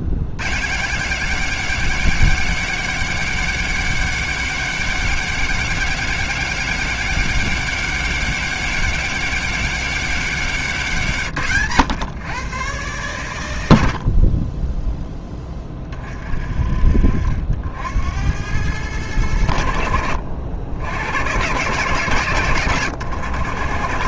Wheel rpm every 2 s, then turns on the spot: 130, 200, 200, 200, 200, 170, 120, 10, 50, 100, 90, 110.
none